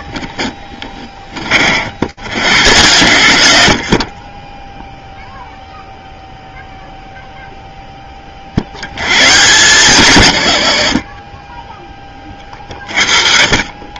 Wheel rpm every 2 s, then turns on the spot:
20, 110, 0, 0, 100, 30, 40.
none